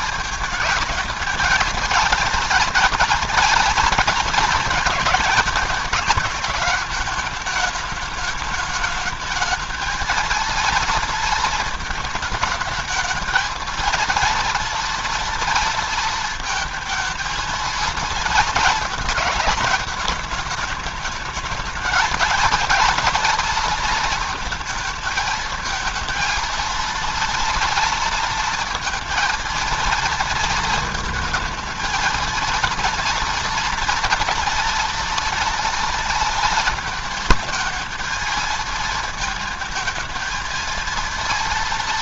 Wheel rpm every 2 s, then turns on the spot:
230, 230, 230, 210, 210, 230, 210, 230, 230, 220, 210, 230, 220, 230, 230, 220, 230, 230, 230, 230, 230.
none